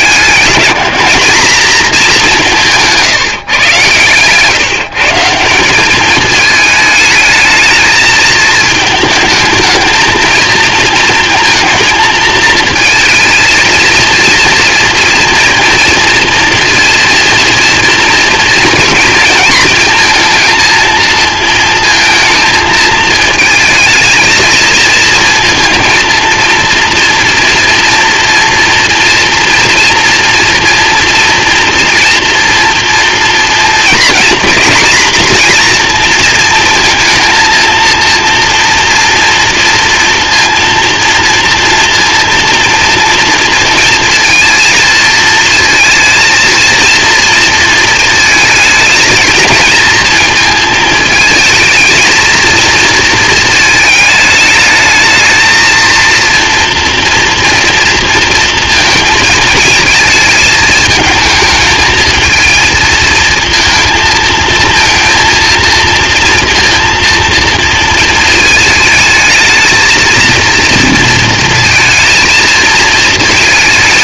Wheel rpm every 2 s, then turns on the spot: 180, 160, 150, 220, 220, 230, 230, 230, 230, 230, 230, 220, 220, 230, 230, 230, 230, 240, 230, 230, 230, 230, 220, 230, 220, 220, 220, 220, 230, 230, 220, 220, 230, 230, 220, 230, 220.
none